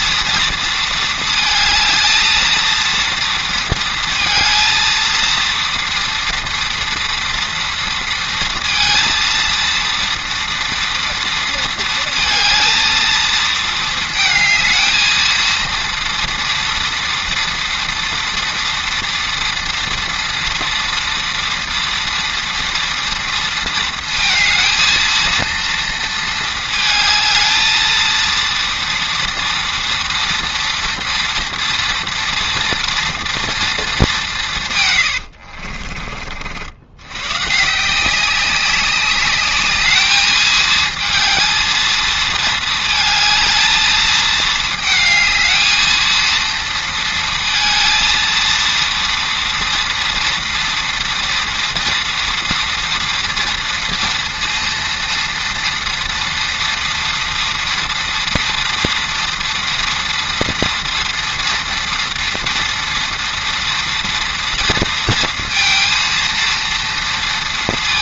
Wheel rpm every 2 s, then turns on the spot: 230, 230, 230, 230, 230, 230, 230, 220, 230, 230, 230, 230, 230, 220, 230, 230, 230, 150, 60, 190, 220, 220, 220, 230, 230, 230, 230, 230, 230, 230, 240, 230, 230, 230.
none